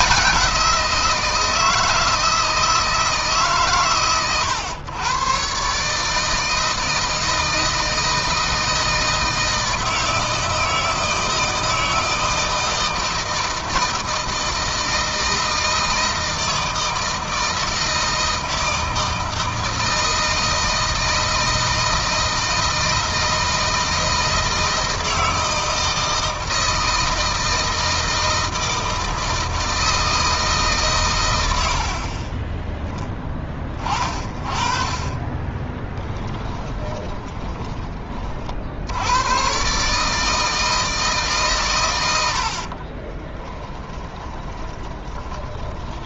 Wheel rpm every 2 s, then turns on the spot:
170, 160, 120, 160, 160, 160, 160, 160, 160, 160, 160, 160, 160, 160, 160, 130, 10, 30, 10, 80, 160, 40, 20.
36-38 42-46